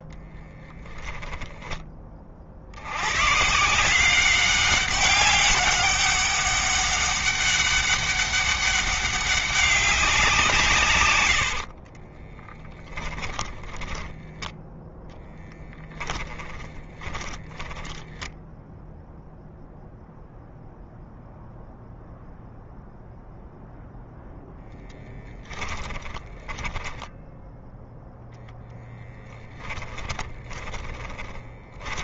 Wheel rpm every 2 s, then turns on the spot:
10, 100, 200, 200, 200, 120, 10, 10, 20, 0, 0, 0, 10, 10, 10, 10.
0-2 12-14 16-18 26-32